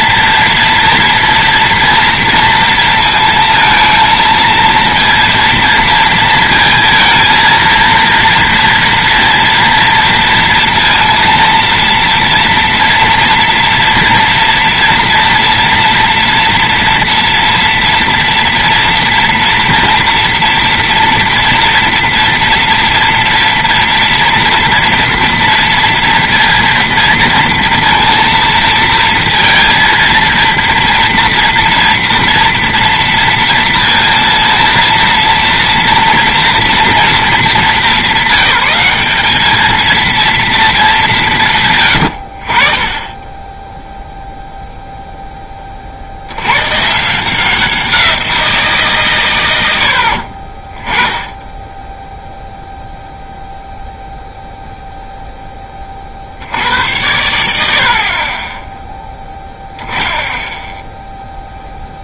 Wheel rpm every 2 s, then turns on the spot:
230, 230, 230, 230, 230, 230, 230, 230, 230, 230, 230, 230, 230, 230, 230, 230, 230, 230, 230, 190, 220, 40, 0, 110, 170, 40, 0, 0, 80, 10, 0.
none